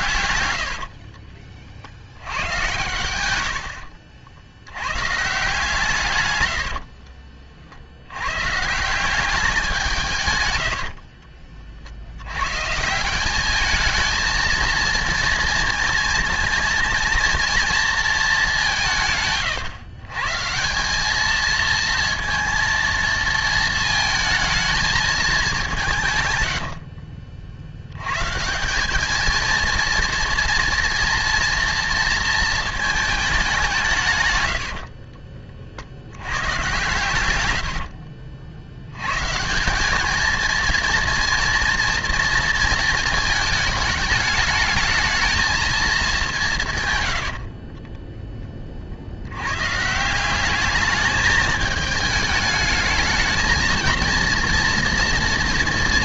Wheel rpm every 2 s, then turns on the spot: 80, 110, 100, 70, 160, 100, 130, 230, 230, 180, 180, 230, 220, 80, 180, 230, 220, 80, 100, 80, 230, 230, 210, 150, 40, 210, 220, 230.
0-2 6-8 10-12 26-28 34-36